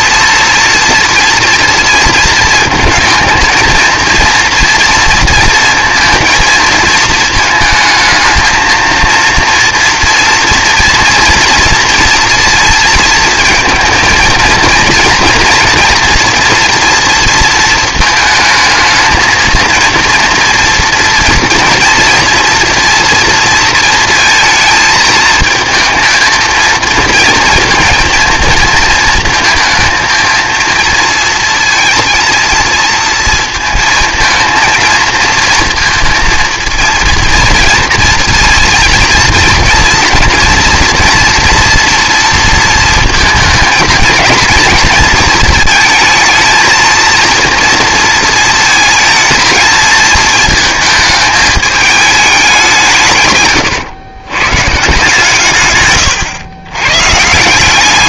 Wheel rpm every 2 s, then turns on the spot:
230, 220, 230, 230, 230, 230, 230, 230, 230, 220, 230, 230, 220, 230, 230, 230, 220, 230, 230, 240, 240, 220, 230, 230, 230, 220, 140, 150, 130.
none